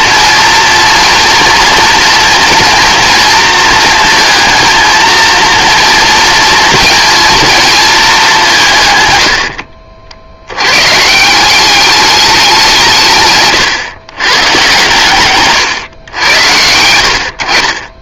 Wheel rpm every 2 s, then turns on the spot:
230, 230, 230, 230, 140, 120, 170, 130, 80.
none